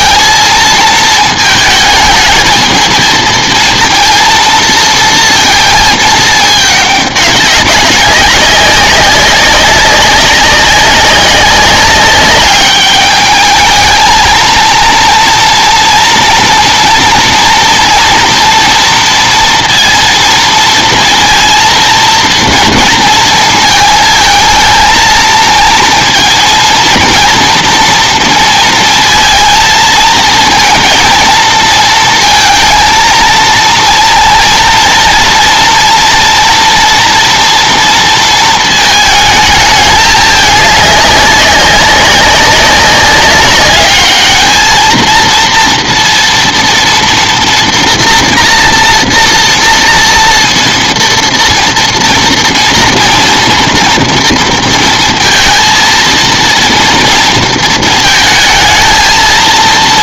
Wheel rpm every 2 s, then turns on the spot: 220, 220, 230, 220, 200, 190, 200, 230, 230, 230, 220, 230, 220, 230, 230, 230, 230, 230, 240, 220, 210, 190, 220, 230, 240, 230, 230, 230, 230, 220.
none